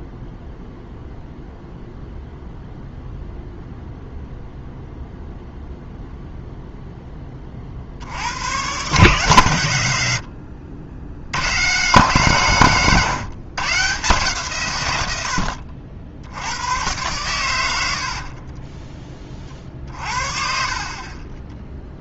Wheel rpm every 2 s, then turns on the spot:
0, 0, 0, 0, 120, 80, 150, 120, 100, 30, 40.
18-20